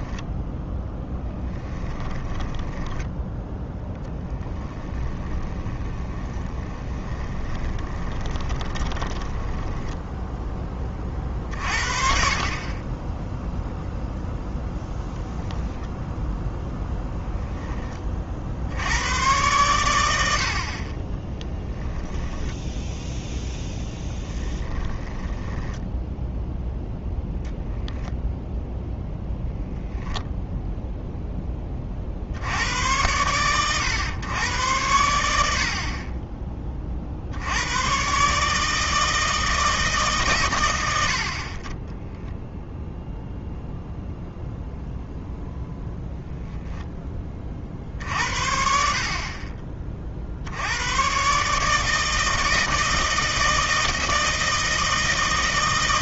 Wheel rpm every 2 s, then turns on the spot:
10, 10, 20, 20, 20, 20, 20, 0, 0, 90, 30, 0, 10, 0, 0, 0, 90, 90, 40, 150, 50, 0, 0, 10, 60, 110, 160, 160.
0-10 24-26